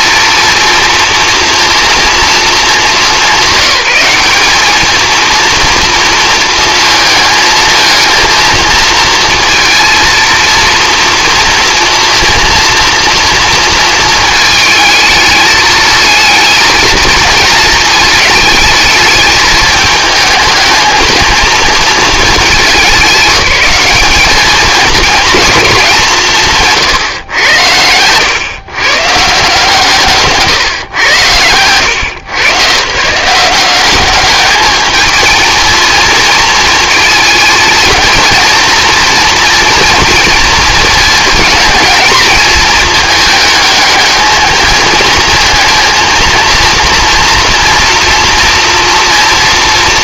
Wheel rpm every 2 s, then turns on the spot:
230, 190, 220, 230, 230, 230, 230, 220, 220, 220, 220, 180, 210, 140, 140, 130, 130, 210, 230, 230, 230, 220, 220, 230, 240.
none